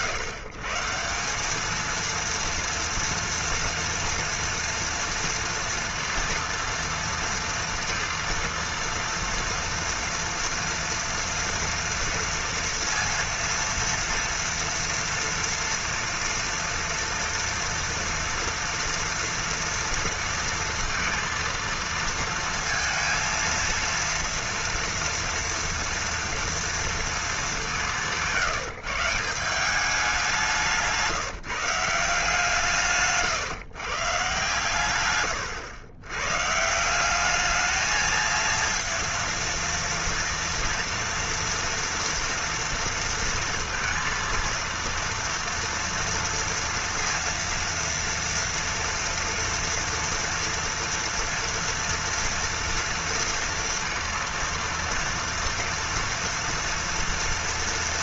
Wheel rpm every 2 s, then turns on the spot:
150, 230, 230, 230, 230, 230, 230, 230, 230, 240, 230, 230, 230, 230, 160, 160, 160, 130, 170, 230, 230, 230, 230, 230, 230, 240, 230, 230, 230.
30-32